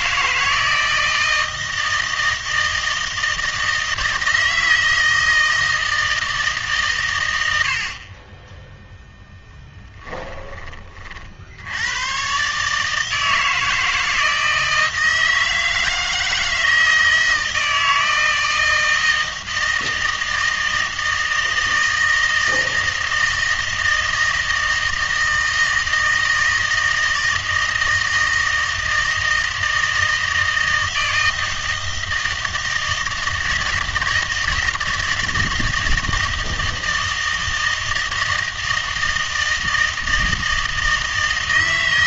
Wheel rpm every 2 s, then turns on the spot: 160, 160, 160, 140, 10, 40, 150, 160, 160, 160, 160, 160, 160, 160, 160, 160, 160, 160, 160, 160, 160.
none